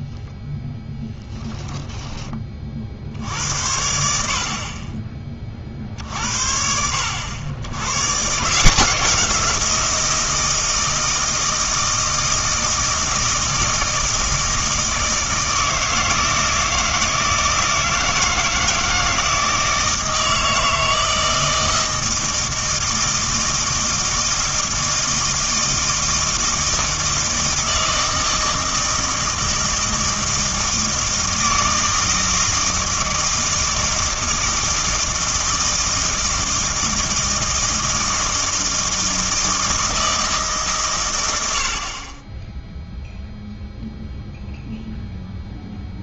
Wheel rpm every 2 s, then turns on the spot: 10, 40, 50, 70, 150, 160, 160, 160, 160, 160, 160, 160, 160, 160, 160, 160, 160, 160, 160, 160, 150, 10, 0.
none